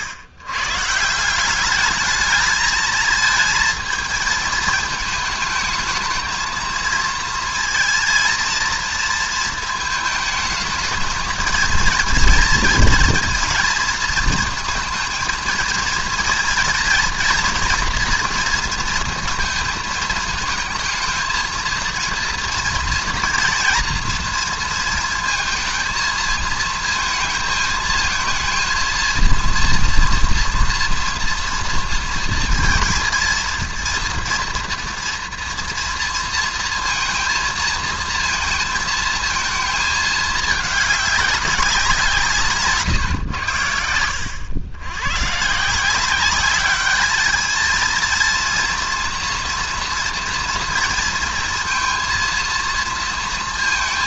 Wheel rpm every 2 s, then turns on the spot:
130, 220, 220, 220, 230, 220, 230, 230, 230, 230, 220, 230, 230, 230, 230, 230, 230, 230, 230, 230, 210, 150, 100, 200, 230, 230, 230.
none